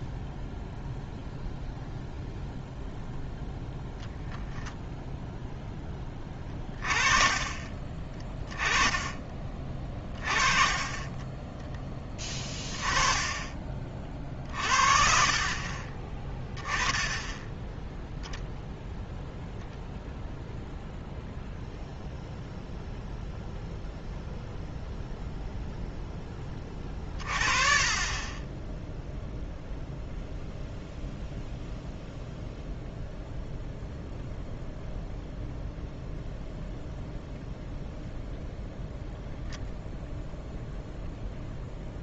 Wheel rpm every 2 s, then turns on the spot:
0, 0, 0, 30, 10, 30, 20, 40, 10, 0, 0, 0, 0, 20, 10, 0, 0, 0, 0, 0, 0.
10-12